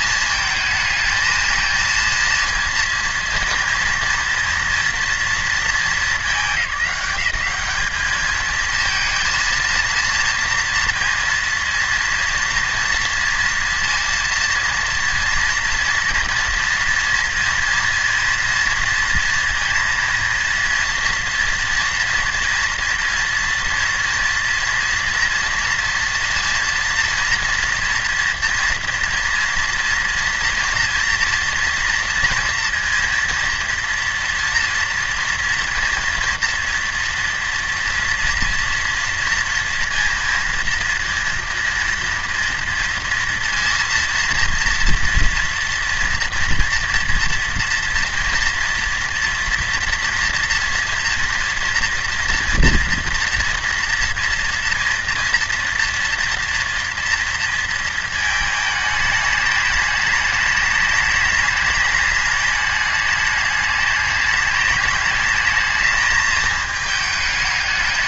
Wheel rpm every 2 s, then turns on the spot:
220, 230, 230, 200, 220, 230, 230, 230, 230, 230, 230, 230, 230, 230, 230, 230, 230, 230, 230, 230, 230, 230, 230, 230, 240, 230, 230, 240, 230, 220, 210, 210, 210, 220.
none